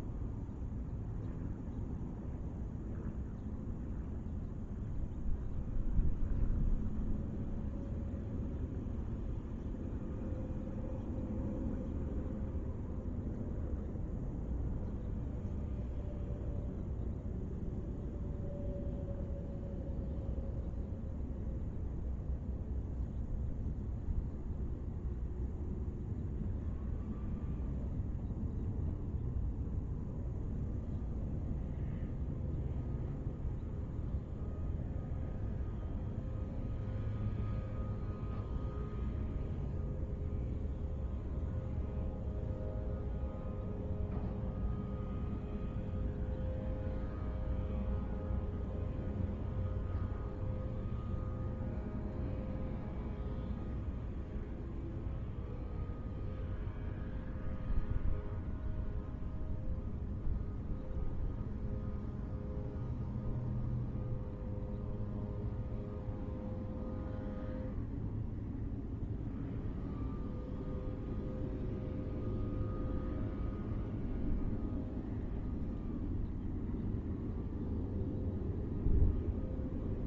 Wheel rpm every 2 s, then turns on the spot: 0, 0, 0, 0, 0, 0, 0, 0, 0, 0, 0, 0, 0, 0, 0, 0, 0, 0, 0, 0, 0, 0, 0, 0, 0, 0, 0, 0, 0, 0, 0, 0, 0, 0, 0, 0, 0, 0, 0, 0.
none